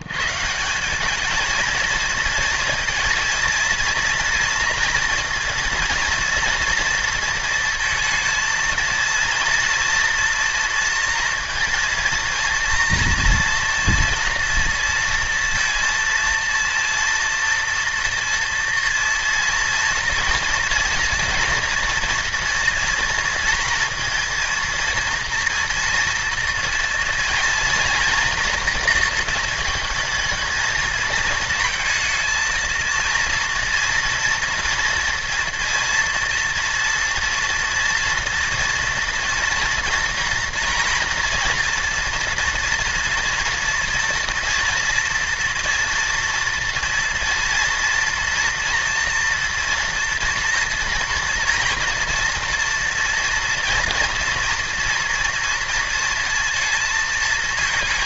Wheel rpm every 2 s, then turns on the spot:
170, 230, 230, 230, 230, 230, 230, 230, 230, 230, 230, 240, 230, 230, 230, 220, 230, 230, 240, 230, 230, 230, 230, 230, 230, 230, 230, 230, 230.
none